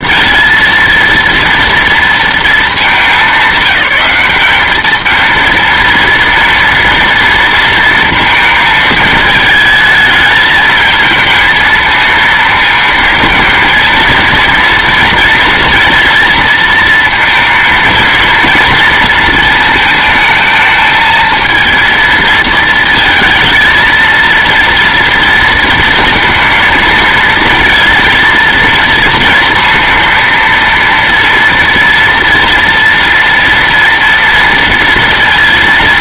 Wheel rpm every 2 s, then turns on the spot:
230, 220, 210, 230, 220, 220, 230, 230, 230, 230, 220, 220, 230, 230, 230, 230, 230, 230.
none